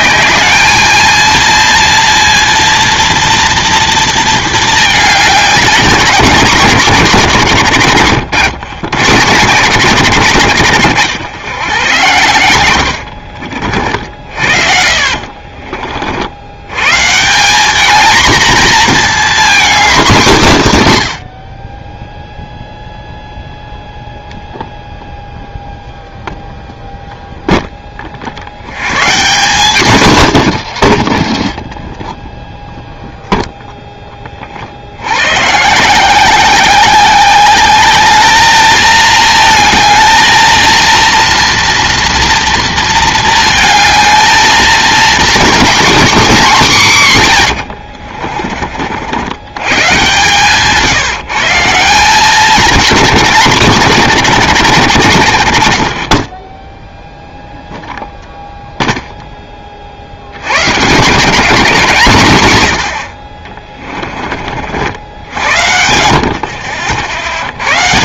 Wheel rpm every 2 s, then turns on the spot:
220, 230, 220, 160, 100, 100, 90, 50, 110, 230, 150, 0, 0, 0, 110, 120, 0, 60, 190, 220, 230, 230, 220, 180, 50, 140, 190, 140, 10, 0, 120, 90, 60, 60.
14-16 30-32 56-58